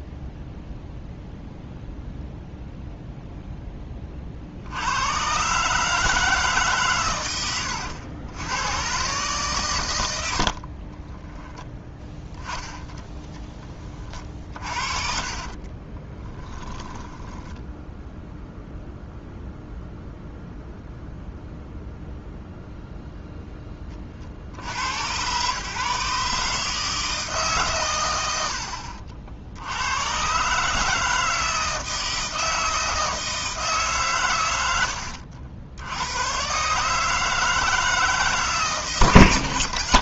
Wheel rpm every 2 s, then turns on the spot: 0, 0, 90, 140, 120, 30, 20, 40, 10, 0, 0, 0, 80, 150, 70, 150, 160, 90, 150, 140.
10-18